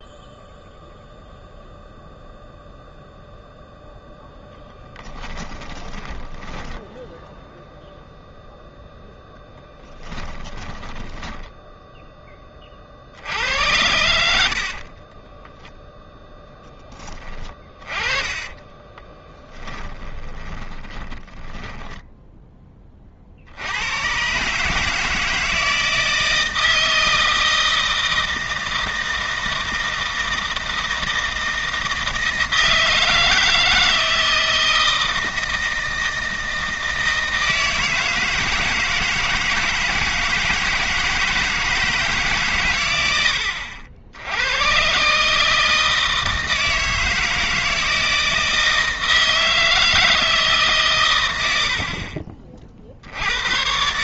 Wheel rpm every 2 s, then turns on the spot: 0, 0, 10, 10, 0, 10, 30, 60, 10, 20, 20, 10, 150, 160, 160, 160, 160, 160, 160, 160, 160, 130, 110, 160, 160, 150, 50.
6-8 10-12 14-16 18-22